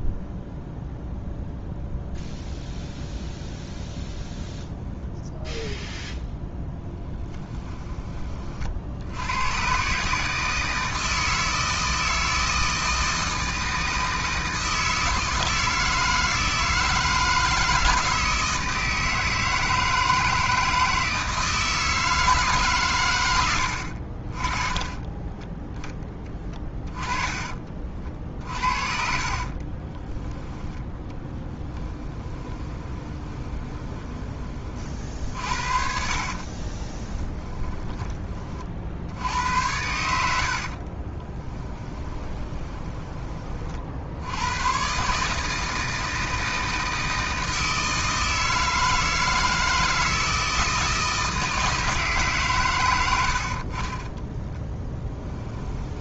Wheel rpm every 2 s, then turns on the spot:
0, 0, 0, 10, 60, 160, 160, 160, 160, 160, 160, 120, 20, 20, 50, 20, 20, 40, 30, 60, 40, 20, 130, 160, 160, 160, 100, 10.
6-8 24-34 36-38 40-42